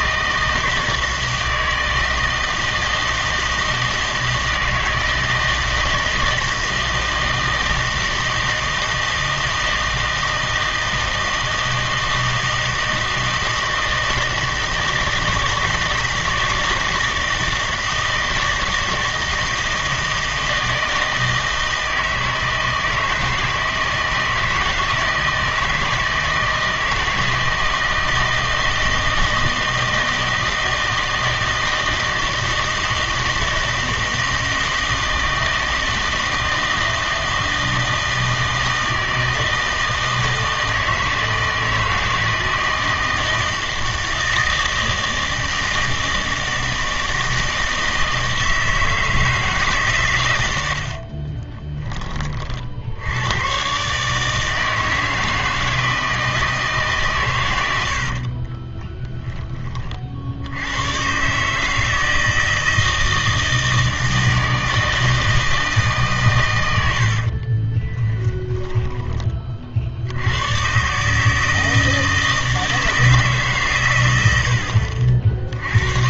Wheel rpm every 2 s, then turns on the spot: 160, 160, 160, 160, 160, 160, 160, 160, 160, 160, 160, 160, 160, 160, 160, 160, 160, 160, 160, 160, 160, 160, 160, 160, 160, 70, 60, 160, 150, 20, 100, 160, 160, 90, 10, 120, 160, 60.
50-52 58-60 68-70